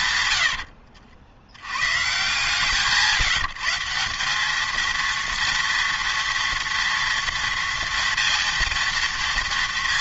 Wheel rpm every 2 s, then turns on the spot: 70, 160, 220, 230, 230.
0-2